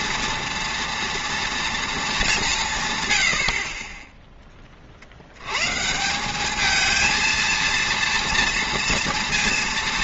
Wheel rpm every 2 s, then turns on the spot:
230, 170, 30, 220, 230.
none